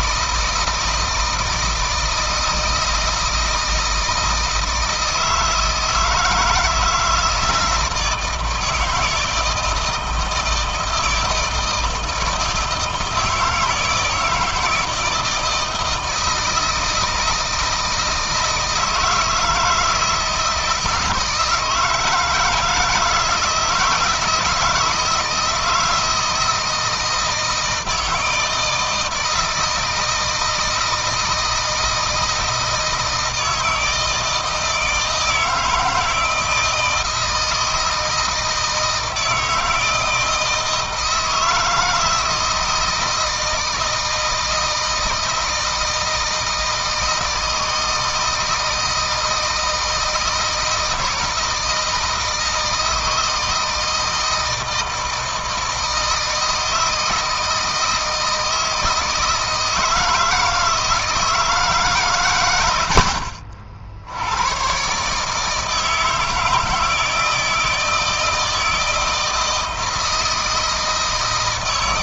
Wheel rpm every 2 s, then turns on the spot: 160, 160, 160, 160, 160, 160, 160, 160, 160, 160, 170, 160, 160, 160, 160, 160, 160, 160, 160, 160, 160, 170, 160, 160, 160, 160, 160, 160, 160, 160, 160, 90, 120, 160, 160, 160.
none